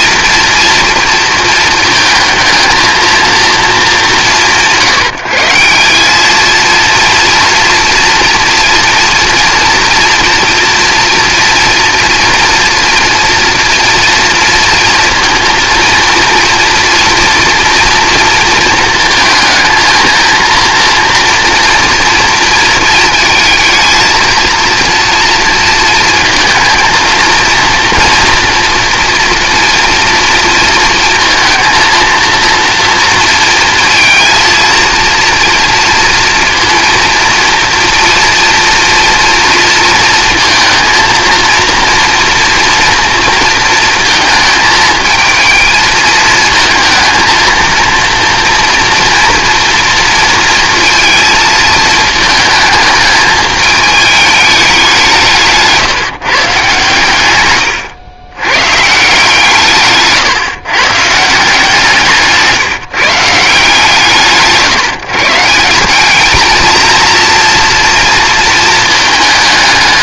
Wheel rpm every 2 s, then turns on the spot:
230, 220, 160, 230, 230, 230, 230, 230, 230, 230, 240, 230, 230, 220, 240, 230, 230, 230, 230, 230, 230, 230, 220, 220, 230, 230, 220, 190, 140, 130, 120, 160, 150, 230, 220.
none